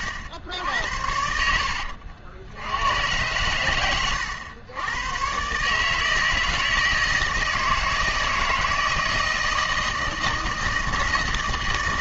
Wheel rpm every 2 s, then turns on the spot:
80, 90, 100, 160, 160, 160.
none